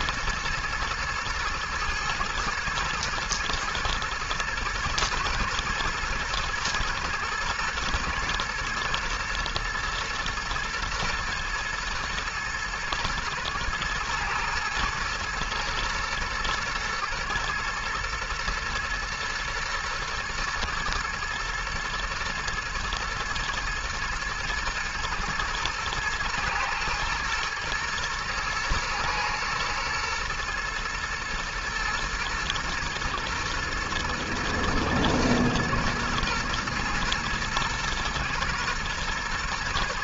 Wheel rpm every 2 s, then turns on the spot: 110, 110, 120, 110, 120, 110, 120, 110, 110, 120, 110, 110, 120, 110, 120, 120, 120, 120, 120, 120.
none